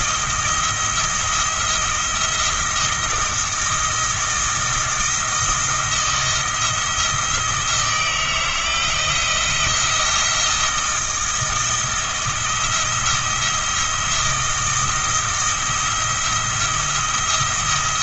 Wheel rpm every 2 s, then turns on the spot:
170, 170, 170, 170, 160, 170, 170, 160, 170.
none